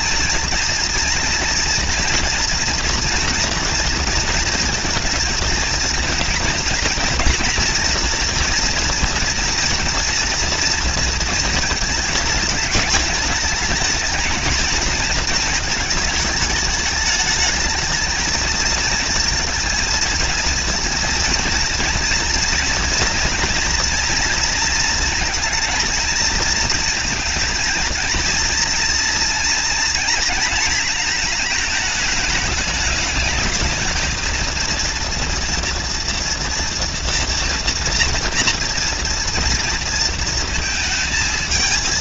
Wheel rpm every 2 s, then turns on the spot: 230, 230, 230, 230, 240, 230, 220, 220, 210, 220, 230, 230, 230, 230, 230, 220, 210, 230, 230, 230, 230.
none